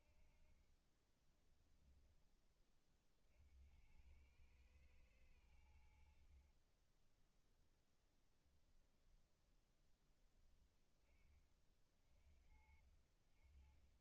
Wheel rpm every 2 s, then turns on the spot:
20, 110, 30, 10, 10, 50, 30.
4-6